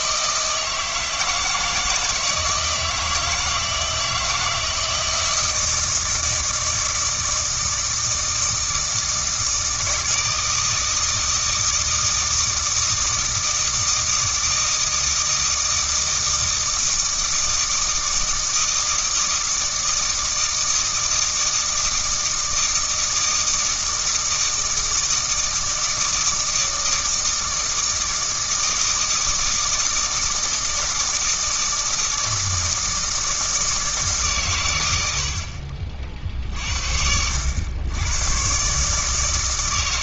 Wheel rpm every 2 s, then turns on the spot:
160, 160, 160, 160, 160, 160, 160, 160, 160, 160, 160, 160, 160, 160, 160, 160, 160, 110, 60, 140.
none